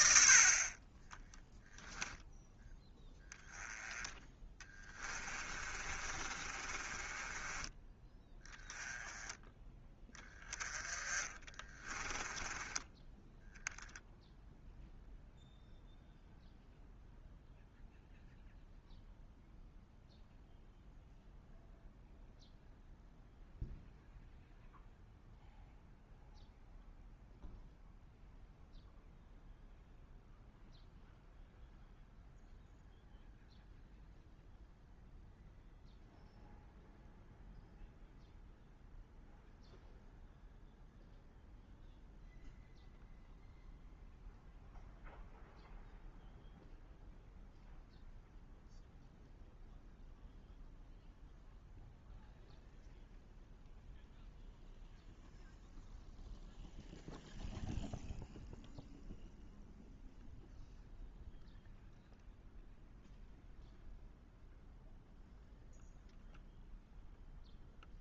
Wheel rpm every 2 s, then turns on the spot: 10, 10, 20, 20, 10, 20, 10, 0, 0, 0, 0, 0, 0, 0, 0, 0, 0, 0, 0, 0, 0, 0, 0, 0, 0, 0, 0, 0, 0, 0, 0, 0, 0, 0.
4-8